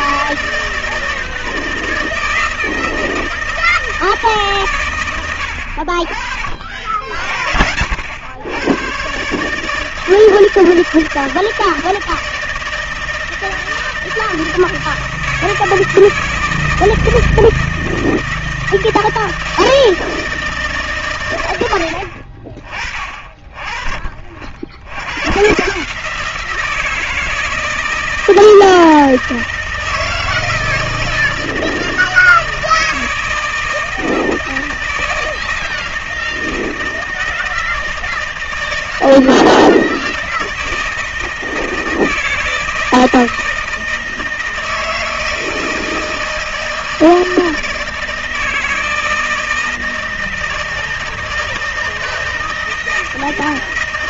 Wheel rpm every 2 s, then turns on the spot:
160, 160, 130, 50, 100, 160, 160, 160, 160, 160, 150, 40, 70, 170, 160, 160, 160, 160, 160, 160, 160, 160, 160, 160, 160, 160, 160.
none